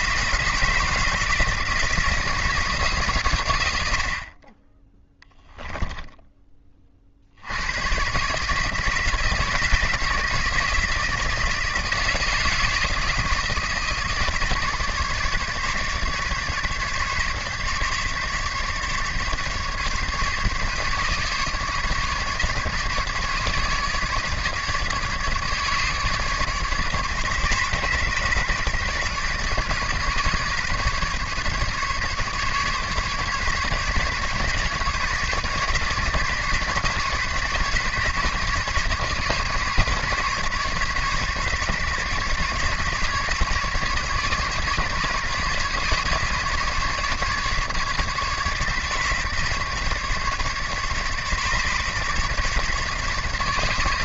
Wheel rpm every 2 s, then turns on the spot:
160, 160, 20, 20, 150, 160, 160, 150, 150, 150, 150, 150, 150, 150, 150, 140, 140, 140, 140, 140, 140, 140, 150, 150, 150, 150, 140.
none